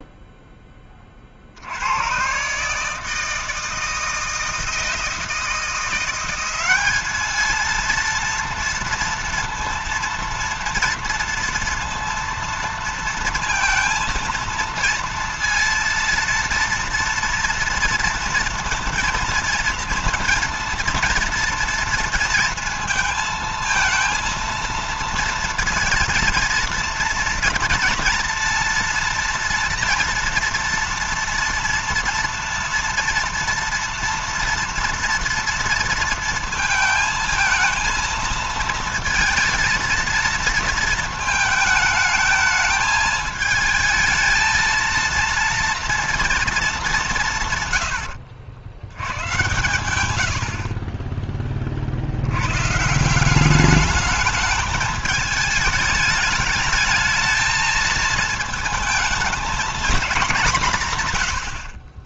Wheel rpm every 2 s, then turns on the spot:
30, 150, 160, 200, 230, 230, 230, 230, 230, 230, 230, 230, 230, 240, 240, 230, 230, 230, 230, 230, 220, 220, 230, 200, 110, 30, 160, 210, 220, 220, 160.
none